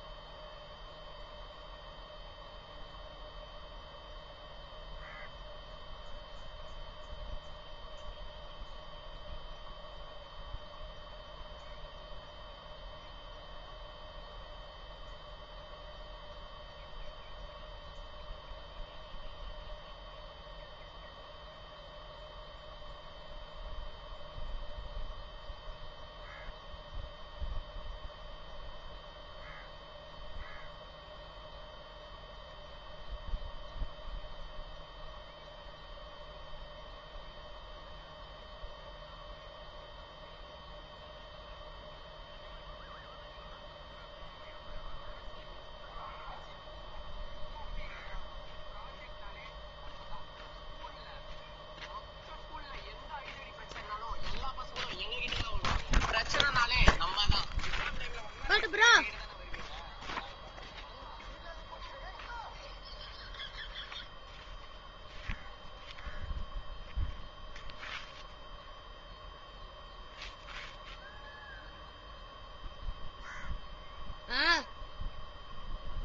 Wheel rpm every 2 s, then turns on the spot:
0, 0, 0, 0, 0, 0, 0, 0, 0, 0, 0, 0, 0, 0, 0, 0, 0, 0, 0, 0, 0, 0, 0, 0, 0, 0, 0, 0, 0, 0, 0, 0, 0, 0, 0, 0, 0, 0.
none